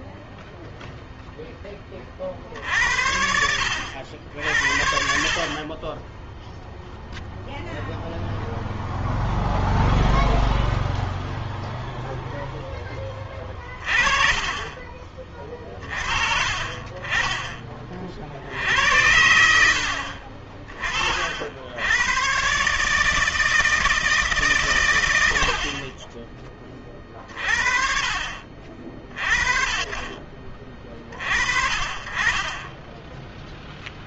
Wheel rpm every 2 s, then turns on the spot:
0, 50, 60, 0, 0, 0, 10, 30, 40, 70, 40, 140, 130, 20, 40, 40, 30.
none